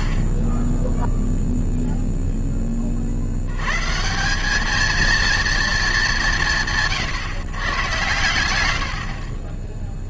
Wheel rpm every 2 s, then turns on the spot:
10, 40, 220, 100, 70.
none